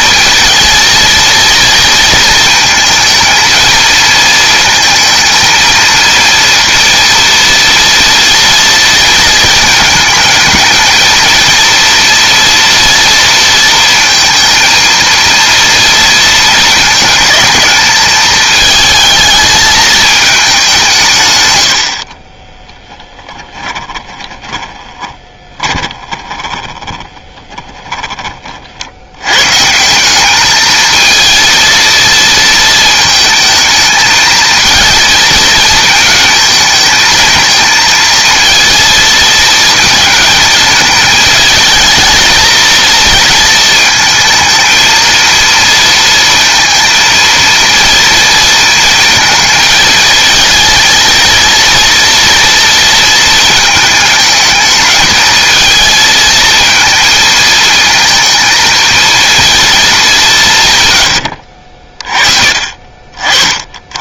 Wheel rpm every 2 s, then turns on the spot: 230, 230, 230, 230, 230, 220, 240, 230, 220, 220, 200, 20, 20, 20, 50, 210, 230, 220, 220, 230, 220, 230, 220, 230, 230, 230, 230, 220, 230, 230, 150, 40.
22-28